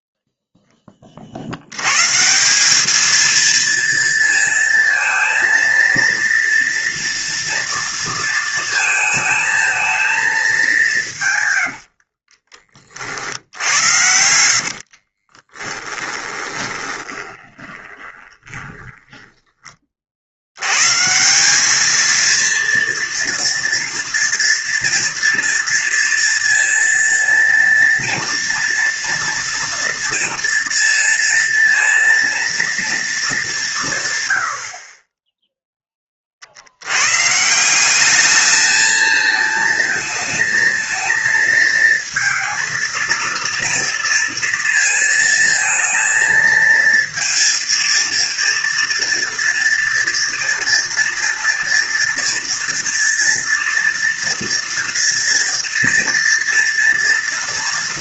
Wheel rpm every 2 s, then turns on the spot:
10, 200, 230, 230, 220, 190, 40, 80, 20, 20, 110, 230, 240, 230, 230, 230, 230, 60, 80, 220, 220, 230, 230, 230, 230, 230, 230, 230, 230.
14-20